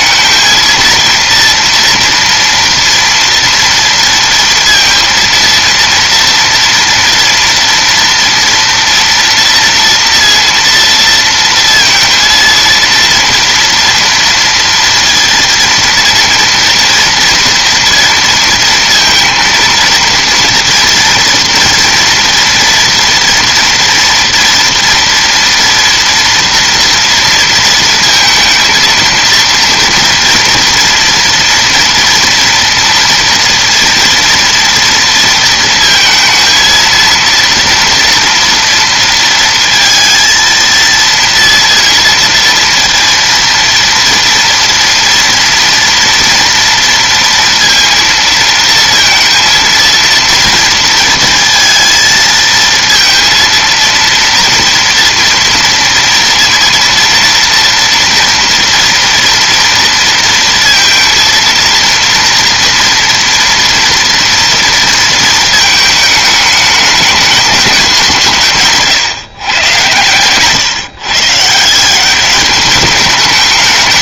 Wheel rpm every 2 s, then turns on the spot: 230, 230, 230, 230, 230, 230, 230, 230, 230, 230, 230, 230, 240, 230, 230, 240, 230, 230, 230, 230, 230, 230, 230, 230, 230, 230, 220, 230, 230, 230, 230, 230, 230, 210, 140, 130, 210.
none